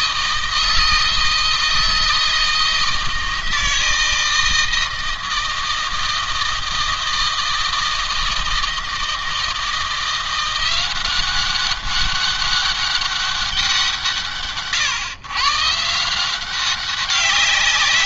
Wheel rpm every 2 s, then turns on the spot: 160, 160, 160, 160, 160, 180, 200, 140, 190.
none